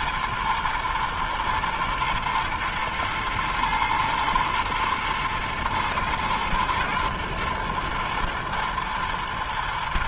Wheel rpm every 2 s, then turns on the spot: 120, 120, 120, 110, 110.
none